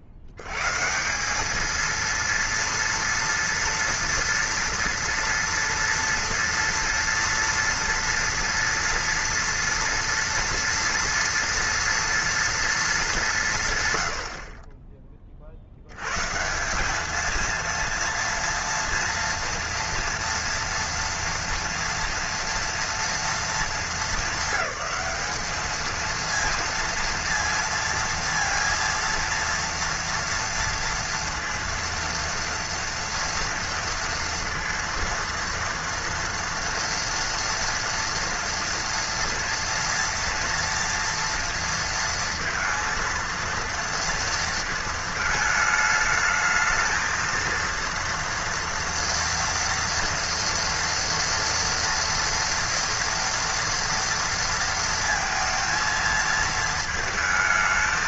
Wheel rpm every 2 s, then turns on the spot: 80, 230, 230, 230, 230, 230, 220, 30, 180, 230, 230, 230, 200, 230, 230, 230, 230, 230, 230, 230, 230, 230, 230, 220, 230, 230, 230, 230, 220.
none